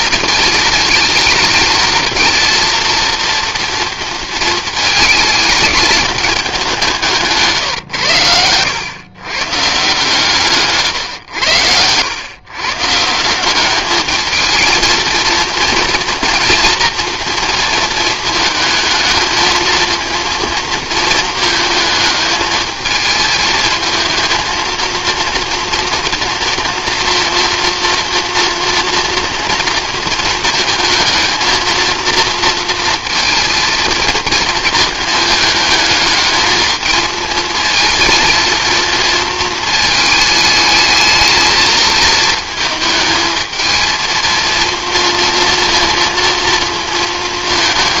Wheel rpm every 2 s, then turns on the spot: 220, 230, 220, 200, 100, 140, 140, 230, 230, 220, 230, 220, 230, 230, 230, 230, 230, 220, 220, 230, 220, 220, 230, 230.
none